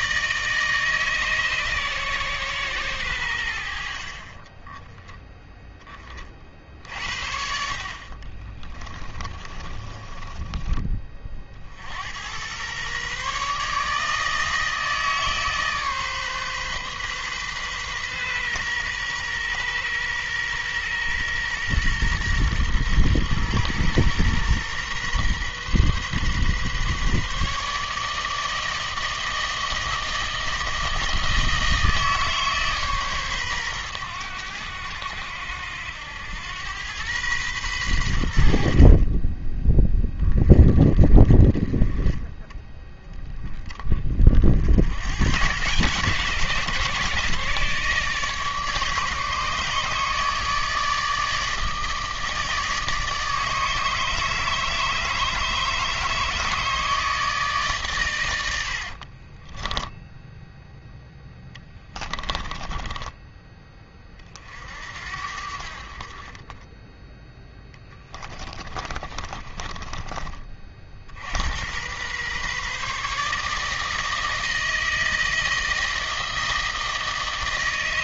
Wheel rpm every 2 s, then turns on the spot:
160, 120, 30, 50, 30, 20, 110, 160, 140, 120, 120, 120, 120, 130, 160, 160, 150, 90, 100, 70, 30, 10, 60, 150, 150, 150, 150, 160, 150, 70, 0, 10, 50, 20, 30, 40, 140, 160, 160.
8-12 58-60 62-64 68-70